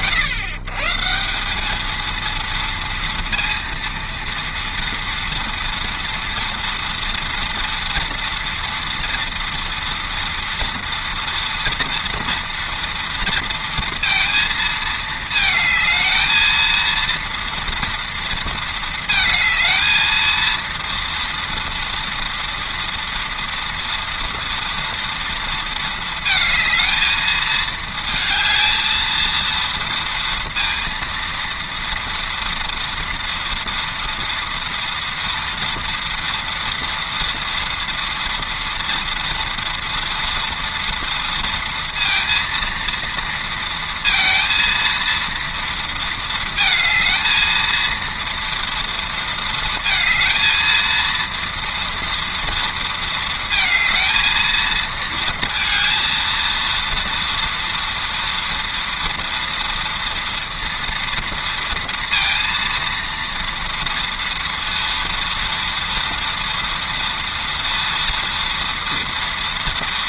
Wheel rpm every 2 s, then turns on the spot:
140, 230, 230, 230, 230, 230, 230, 220, 230, 220, 230, 230, 230, 220, 220, 230, 230, 230, 230, 230, 230, 230, 230, 220, 230, 230, 230, 230, 230, 230, 230, 230, 230, 230, 230.
none